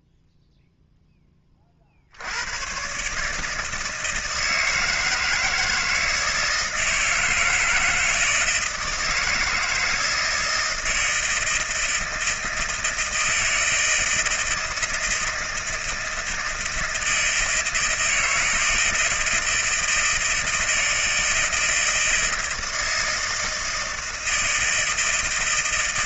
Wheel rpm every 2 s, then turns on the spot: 0, 100, 160, 160, 170, 160, 160, 160, 160, 160, 160, 160, 160.
none